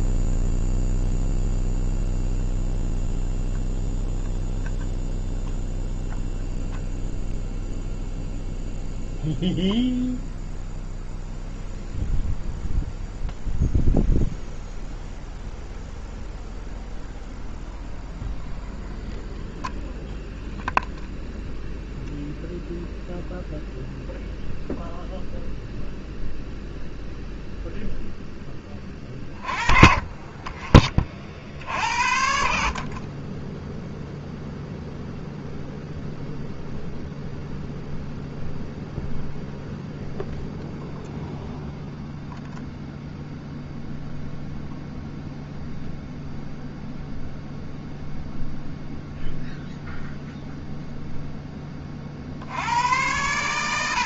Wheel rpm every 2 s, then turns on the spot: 0, 0, 0, 0, 0, 0, 0, 0, 0, 0, 0, 0, 0, 0, 20, 40, 30, 0, 0, 0, 0, 0, 0, 0, 0, 0, 90.
none